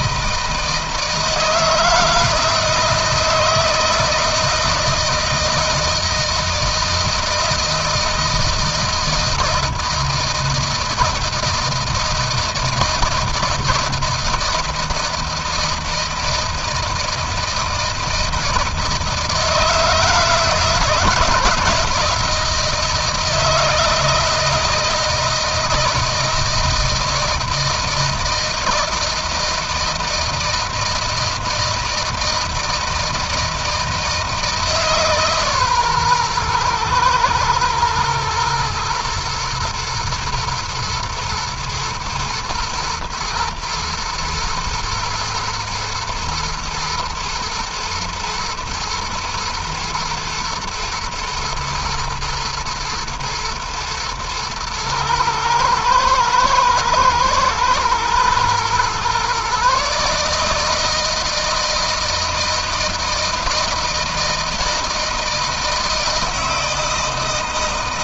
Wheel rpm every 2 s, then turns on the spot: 160, 160, 160, 160, 160, 160, 160, 160, 160, 160, 160, 170, 160, 160, 160, 160, 160, 150, 110, 120, 110, 120, 110, 110, 110, 120, 110, 110, 110, 120, 150, 160, 160, 160.
none